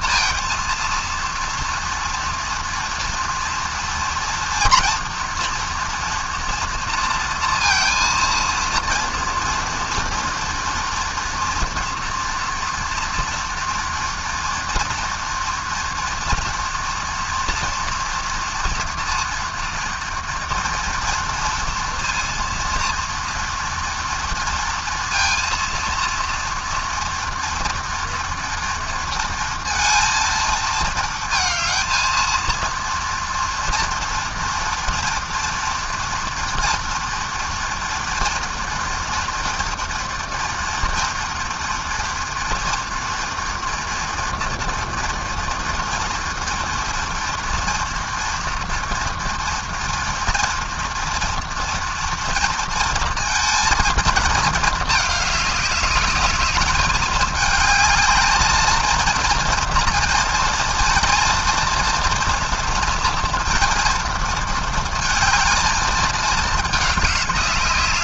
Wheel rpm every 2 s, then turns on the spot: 230, 230, 240, 230, 230, 230, 240, 240, 230, 230, 230, 230, 230, 230, 230, 230, 230, 230, 230, 230, 230, 230, 230, 240, 230, 230, 230, 220, 210, 220, 230, 230, 220, 210.
none